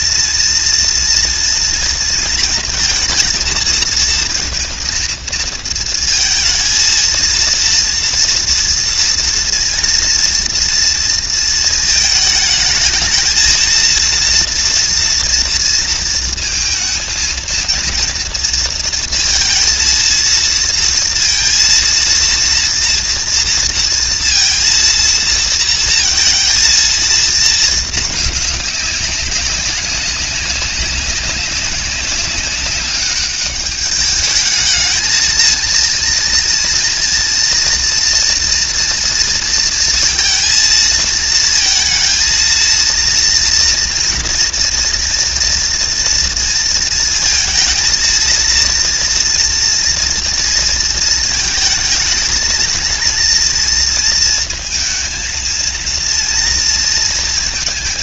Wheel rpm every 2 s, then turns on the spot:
230, 230, 230, 220, 230, 230, 220, 230, 230, 230, 230, 230, 230, 230, 210, 200, 200, 210, 230, 230, 230, 230, 230, 230, 230, 230, 220, 230, 230.
none